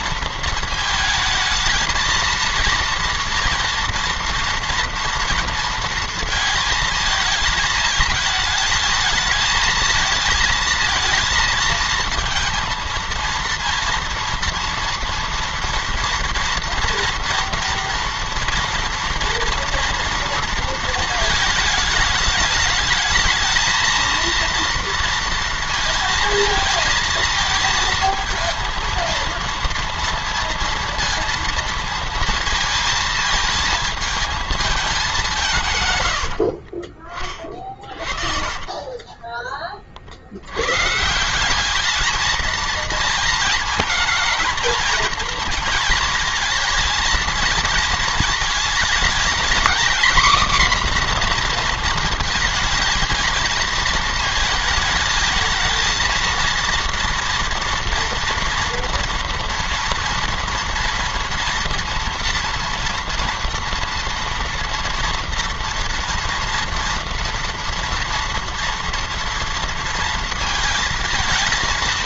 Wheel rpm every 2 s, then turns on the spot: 220, 230, 230, 220, 220, 230, 230, 230, 240, 230, 230, 220, 230, 230, 230, 230, 220, 210, 50, 10, 120, 220, 220, 230, 230, 250, 220, 220, 230, 230, 230, 230, 230, 230, 230, 230.
38-40